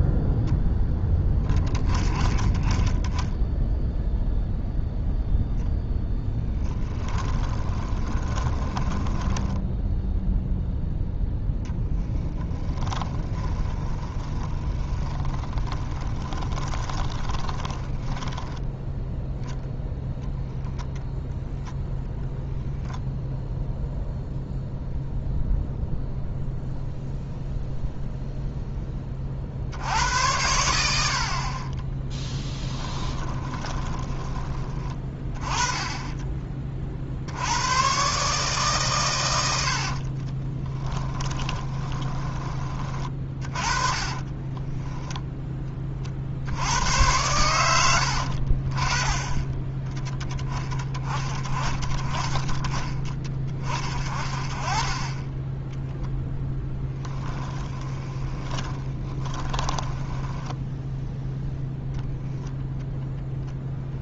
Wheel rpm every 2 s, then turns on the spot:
10, 10, 0, 10, 20, 0, 20, 30, 20, 0, 0, 10, 0, 0, 10, 60, 10, 20, 50, 120, 10, 30, 10, 90, 30, 20, 20, 20, 10, 10, 0, 0.
6-10 12-18 32-34 40-42 44-46 56-60